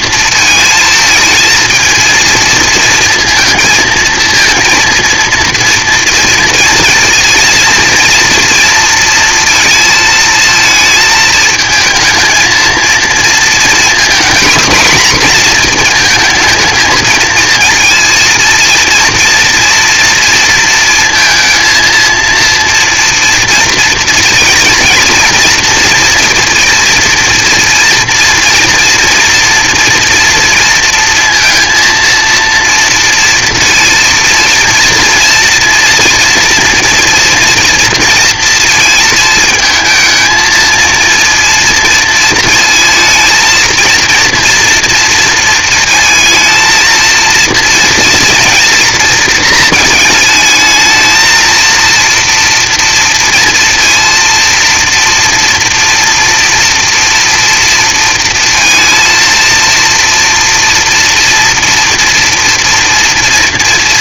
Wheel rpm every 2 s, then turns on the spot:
230, 230, 230, 240, 230, 220, 230, 240, 220, 230, 230, 230, 230, 230, 230, 230, 230, 230, 230, 230, 220, 230, 230, 220, 230, 220, 230, 230, 240, 230, 230, 230.
none